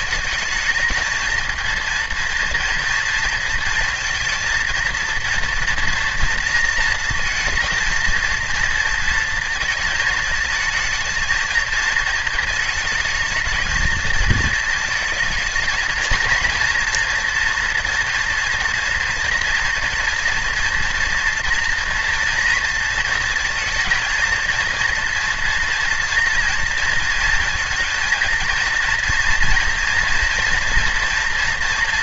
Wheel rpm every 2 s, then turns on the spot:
220, 230, 230, 230, 230, 220, 220, 220, 230, 240, 230, 230, 230, 230, 230, 230.
none